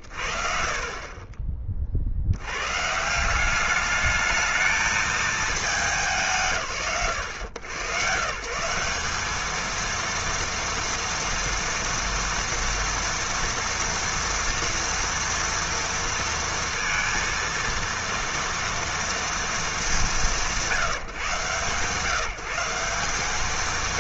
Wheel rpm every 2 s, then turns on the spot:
40, 160, 220, 90, 190, 230, 240, 230, 230, 230, 170, 180.
none